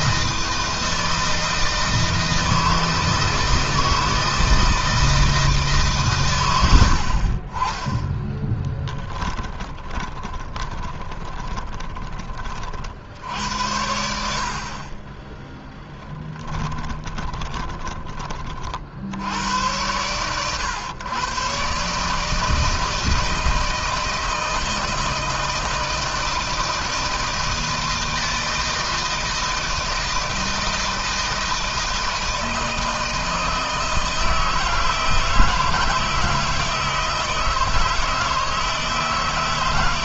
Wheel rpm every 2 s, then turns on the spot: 160, 160, 160, 60, 20, 20, 50, 30, 20, 60, 120, 160, 160, 160, 160, 160, 160, 160, 160, 160.
6-12 16-18